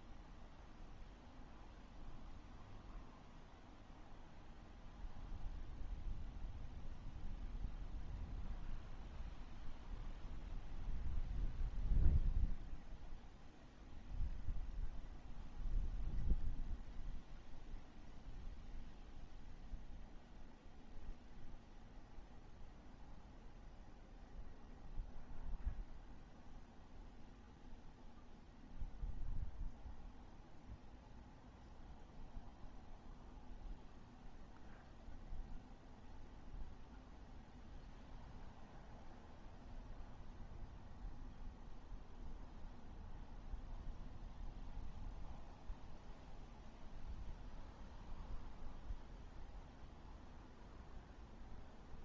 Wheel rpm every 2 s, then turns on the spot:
0, 0, 0, 0, 0, 0, 0, 0, 0, 0, 0, 0, 0, 0, 0, 0, 0, 0, 0, 0, 0, 0, 0, 0, 0, 0.
none